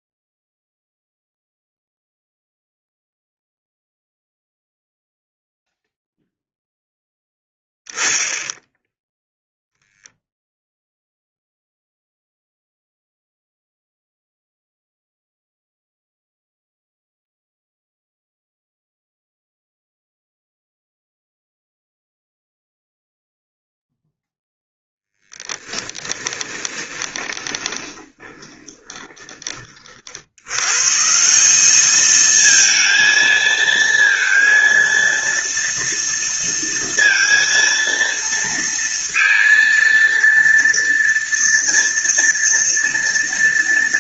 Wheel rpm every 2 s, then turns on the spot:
0, 0, 0, 0, 0, 0, 0, 0, 0, 0, 0, 0, 0, 20, 20, 120, 220, 230, 230, 230, 230, 230.
26-30